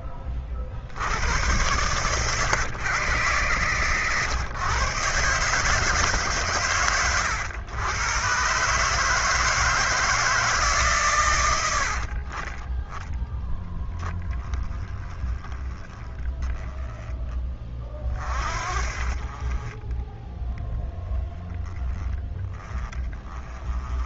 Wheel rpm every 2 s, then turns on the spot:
70, 130, 130, 120, 150, 140, 10, 20, 10, 40, 10, 20.
none